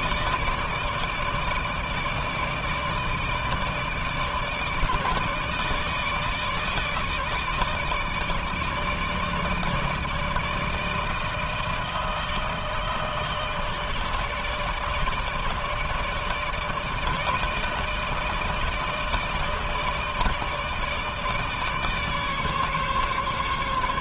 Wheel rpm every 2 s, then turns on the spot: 150, 160, 150, 150, 150, 160, 160, 160, 150, 160, 150, 150.
none